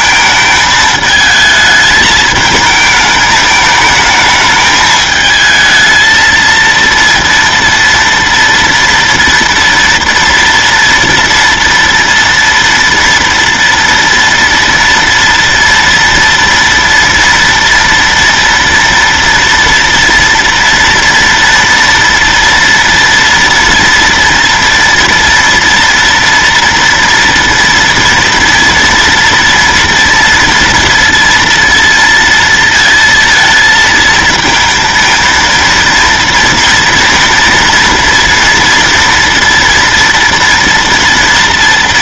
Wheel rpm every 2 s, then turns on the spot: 220, 220, 220, 230, 230, 230, 230, 230, 230, 230, 230, 230, 230, 230, 230, 230, 230, 220, 230, 240, 230.
none